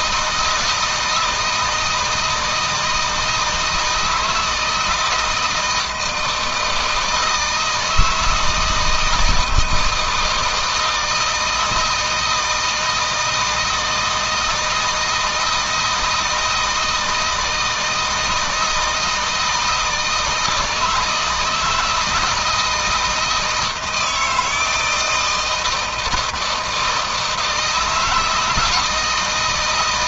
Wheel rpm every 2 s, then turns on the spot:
160, 160, 160, 160, 160, 160, 160, 160, 160, 160, 160, 160, 160, 160, 170.
none